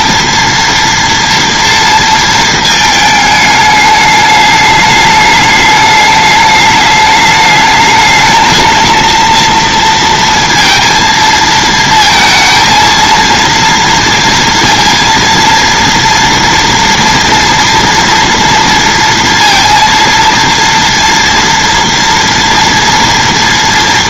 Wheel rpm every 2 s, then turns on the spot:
230, 230, 210, 210, 220, 230, 230, 230, 230, 230, 230, 230.
none